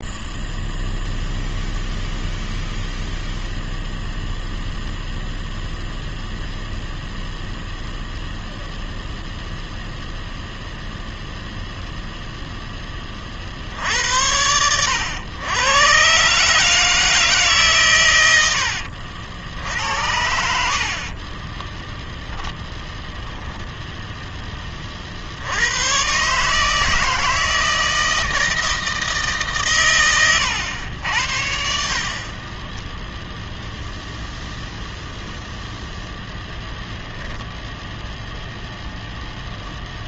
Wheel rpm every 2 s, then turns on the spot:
0, 0, 0, 0, 0, 0, 10, 100, 150, 90, 50, 10, 30, 160, 160, 100, 10, 0, 10, 10.
22-24